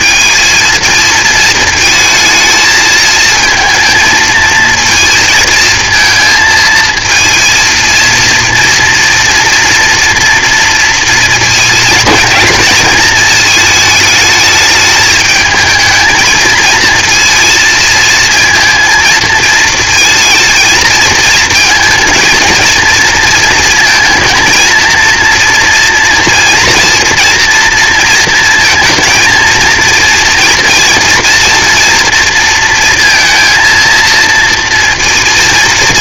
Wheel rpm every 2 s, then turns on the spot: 220, 220, 230, 230, 230, 230, 220, 220, 230, 230, 220, 220, 230, 230, 220, 230, 230, 230.
none